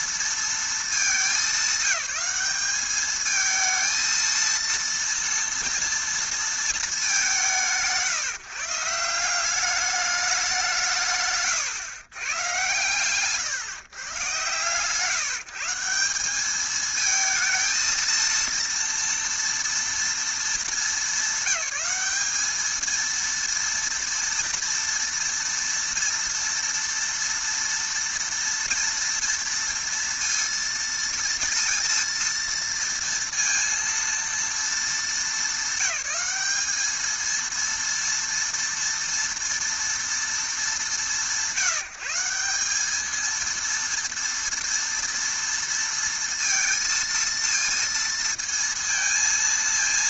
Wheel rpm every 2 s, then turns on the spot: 230, 200, 230, 230, 150, 200, 120, 130, 200, 230, 230, 210, 230, 230, 240, 230, 230, 230, 210, 230, 220, 180, 230, 230, 230.
none